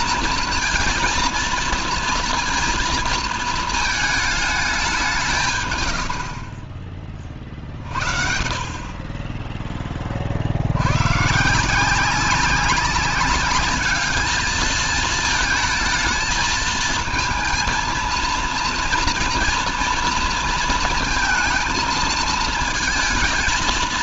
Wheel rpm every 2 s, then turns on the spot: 230, 230, 210, 40, 40, 70, 190, 220, 220, 230, 230, 220.
none